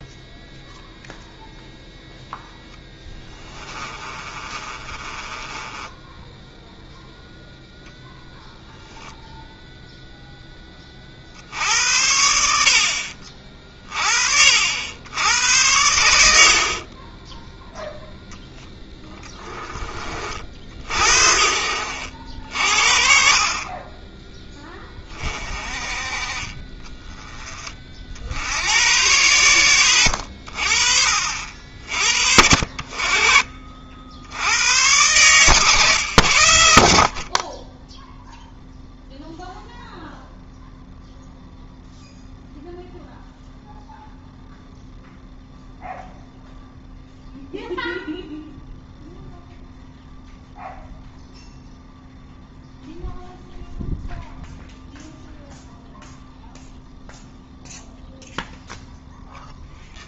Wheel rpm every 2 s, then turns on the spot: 0, 0, 30, 0, 0, 0, 70, 60, 50, 10, 50, 50, 20, 20, 80, 50, 60, 100, 70, 0, 0, 0, 0, 0, 0, 0, 0, 0, 0, 0.
4-6